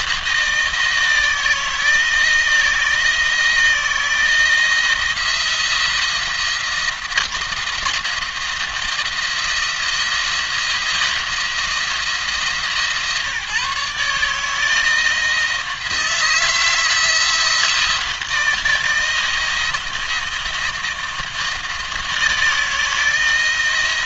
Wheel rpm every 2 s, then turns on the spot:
160, 160, 170, 170, 170, 170, 150, 160, 170, 160, 170, 160.
none